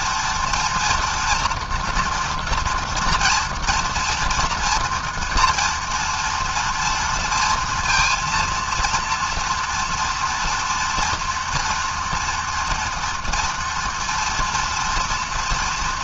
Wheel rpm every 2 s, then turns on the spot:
230, 230, 230, 230, 240, 230, 230, 230.
none